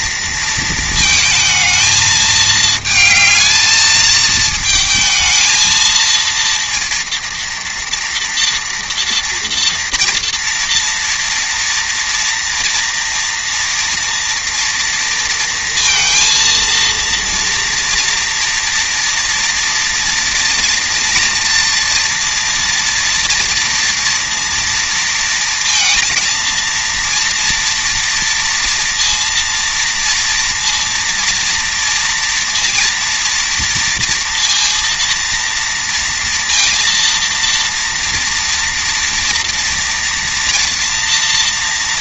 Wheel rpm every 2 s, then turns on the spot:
230, 220, 220, 230, 230, 230, 230, 230, 230, 230, 230, 230, 230, 230, 230, 230, 230, 230, 230, 240, 240.
none